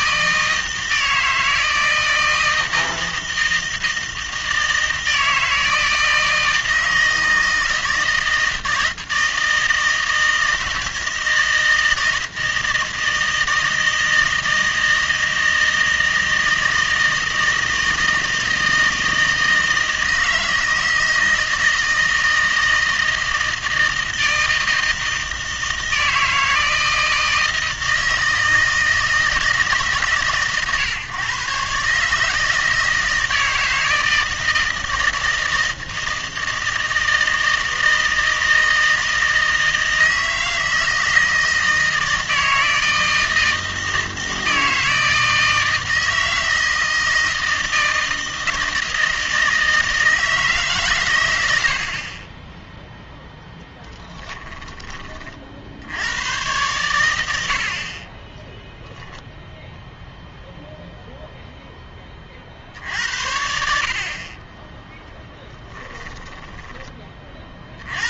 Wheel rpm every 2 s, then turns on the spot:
160, 160, 160, 160, 160, 160, 160, 160, 160, 160, 160, 160, 160, 160, 160, 140, 160, 160, 160, 160, 160, 160, 160, 160, 160, 140, 0, 20, 110, 0, 0, 60, 10, 10.
54-56